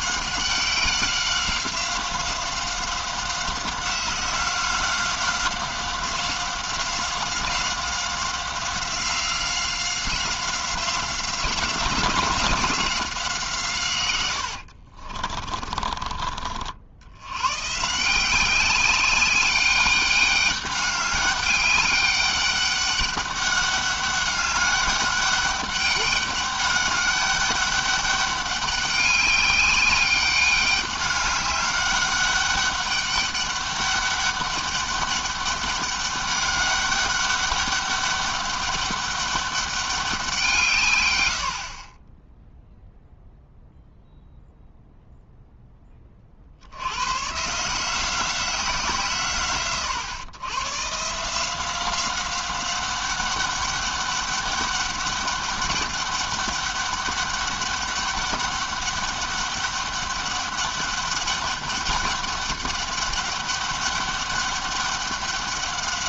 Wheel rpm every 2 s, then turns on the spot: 190, 190, 180, 180, 180, 180, 180, 60, 50, 190, 200, 200, 200, 200, 200, 200, 200, 200, 200, 200, 150, 0, 0, 80, 170, 130, 190, 200, 200, 200, 200, 200, 200.
14-16